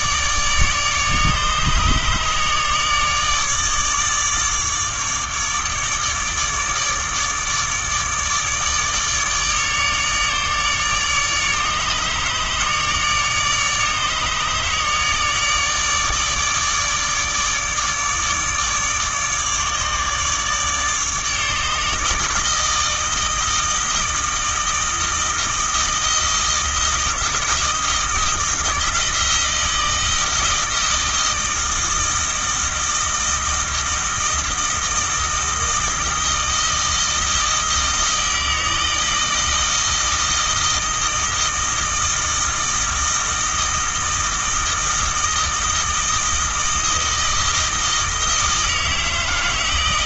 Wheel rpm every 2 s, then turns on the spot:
150, 150, 150, 150, 150, 150, 150, 150, 150, 150, 150, 160, 160, 160, 160, 160, 160, 160, 160, 160, 160, 160, 160, 160, 160.
none